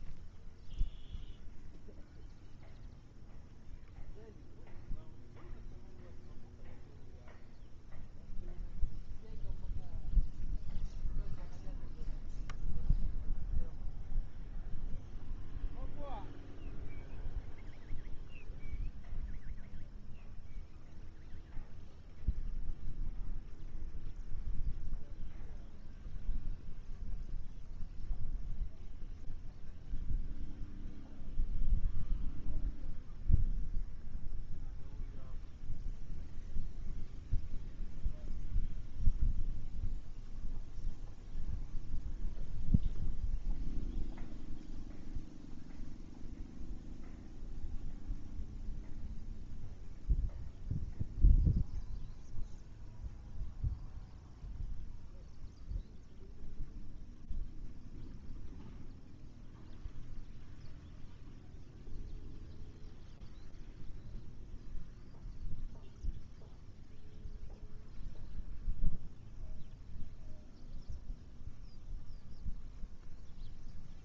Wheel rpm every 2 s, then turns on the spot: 0, 0, 0, 0, 0, 0, 0, 0, 0, 0, 0, 0, 0, 0, 0, 0, 0, 0, 0, 0, 0, 0, 0, 0, 0, 0, 0, 0, 0, 0, 0, 0, 0, 0, 0, 0, 0.
none